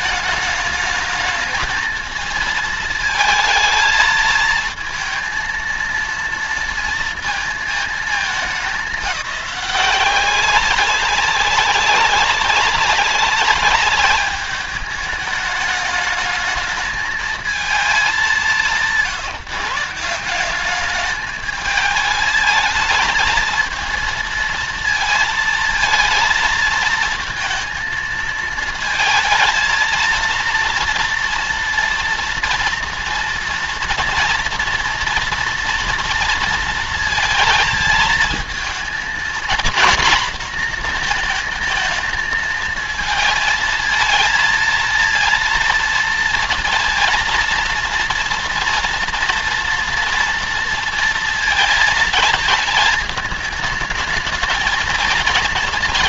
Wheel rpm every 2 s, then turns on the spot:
210, 220, 220, 230, 210, 190, 200, 210, 220, 200, 190, 220, 230, 230, 220, 230, 230, 230, 230, 220, 240, 220, 230, 230, 240, 230, 220, 220.
none